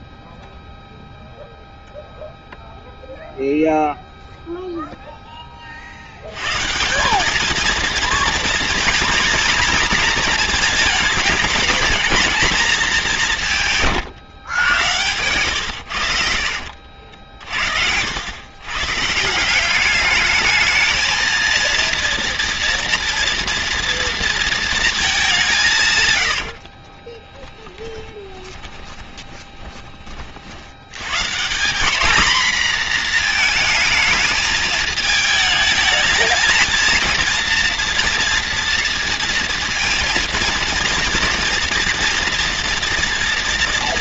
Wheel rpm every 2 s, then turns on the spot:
0, 0, 0, 150, 240, 220, 210, 110, 60, 130, 220, 230, 220, 40, 20, 90, 240, 220, 230, 230, 230, 230.
26-30